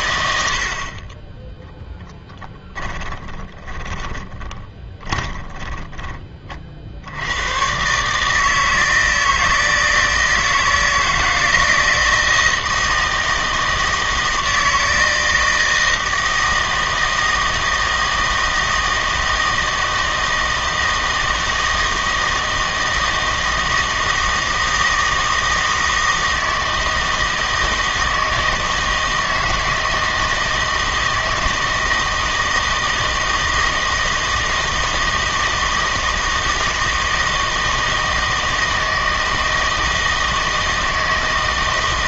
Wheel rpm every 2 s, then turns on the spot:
70, 10, 20, 50, 160, 160, 160, 160, 160, 160, 160, 160, 160, 160, 160, 160, 160, 160, 160, 160, 160.
2-6